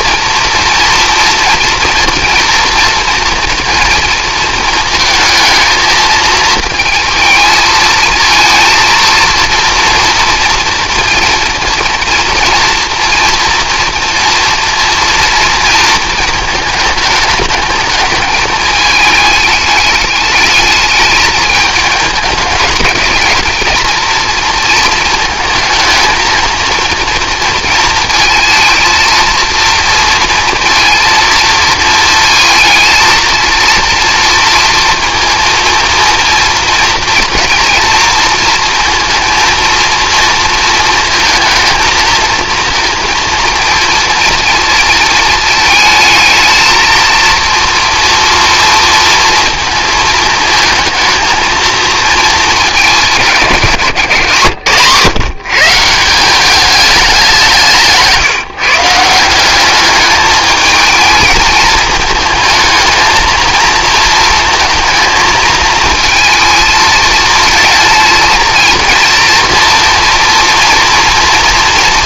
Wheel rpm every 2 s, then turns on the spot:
230, 230, 230, 220, 230, 240, 240, 230, 220, 220, 210, 210, 230, 230, 230, 230, 230, 230, 230, 230, 230, 230, 220, 230, 230, 220, 220, 140, 200, 150, 220, 220, 230, 220, 220, 230.
none